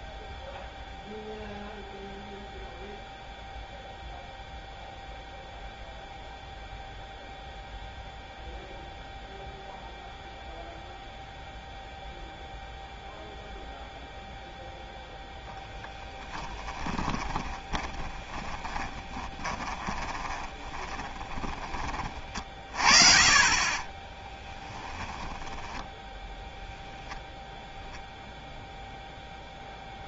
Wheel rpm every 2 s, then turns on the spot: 0, 0, 0, 0, 0, 0, 0, 0, 10, 10, 20, 40, 10, 0, 0.
16-22 24-26